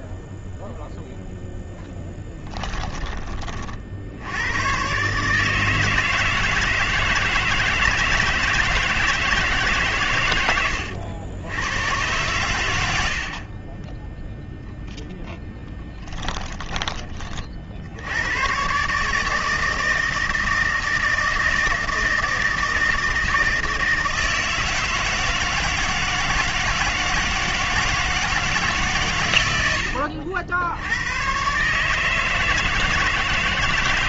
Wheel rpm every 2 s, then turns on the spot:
0, 30, 150, 160, 160, 80, 100, 0, 30, 150, 160, 160, 160, 160, 110, 120, 160.
none